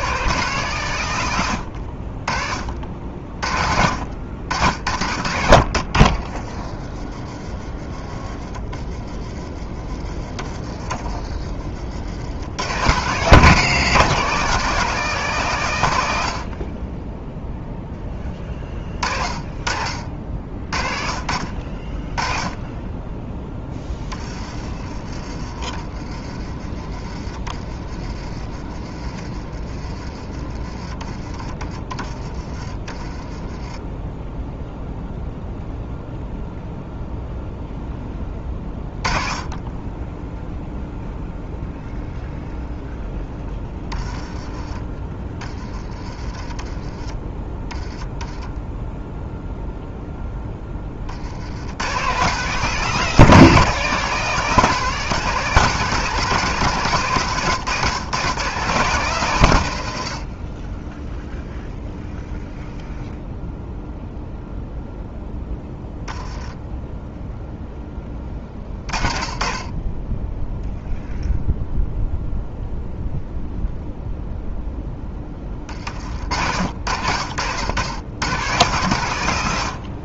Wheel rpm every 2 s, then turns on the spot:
150, 40, 70, 40, 30, 40, 90, 170, 50, 30, 50, 20, 30, 30, 30, 30, 20, 0, 0, 20, 0, 0, 20, 20, 10, 20, 170, 180, 150, 140, 20, 0, 0, 10, 30, 0, 0, 0, 70, 110.
6-8